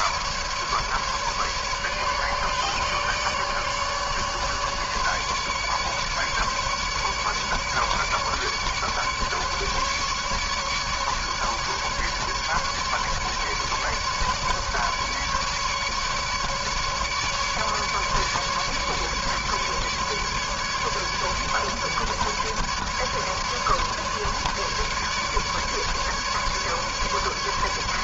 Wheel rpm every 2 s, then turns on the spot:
150, 150, 150, 150, 150, 150, 150, 150, 150, 150, 150, 150, 150, 150.
none